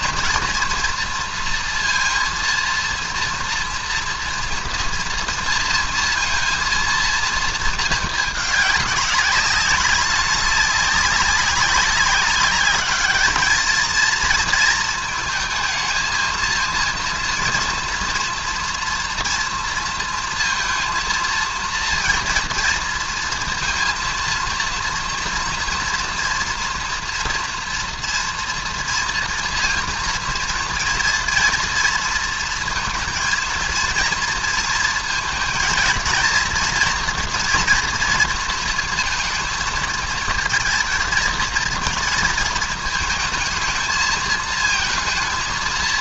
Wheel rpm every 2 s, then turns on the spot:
230, 230, 230, 230, 220, 200, 200, 230, 230, 230, 230, 230, 230, 230, 230, 230, 230, 230, 230, 230, 220, 230, 220.
none